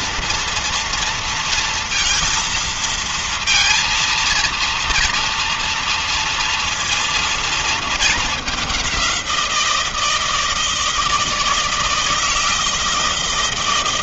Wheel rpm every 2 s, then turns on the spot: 230, 230, 230, 230, 210, 160, 160.
none